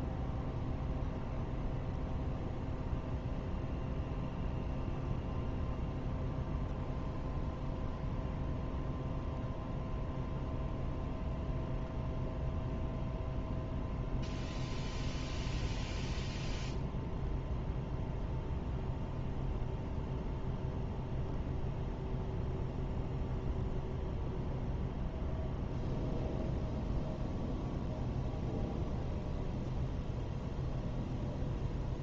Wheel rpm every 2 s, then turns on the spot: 0, 0, 0, 0, 0, 0, 0, 0, 0, 0, 0, 0, 0, 0, 0, 0.
none